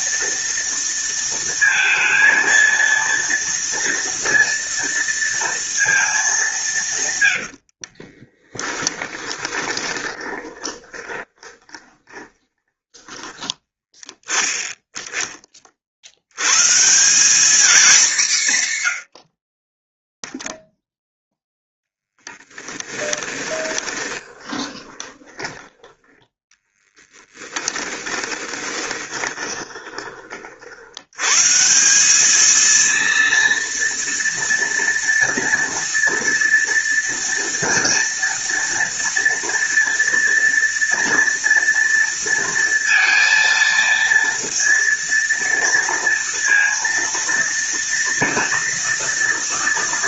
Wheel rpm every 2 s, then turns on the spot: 230, 230, 230, 120, 10, 20, 20, 20, 190, 80, 0, 10, 20, 10, 20, 110, 230, 240, 230, 230, 230, 230, 230, 230, 230.
6-14 22-30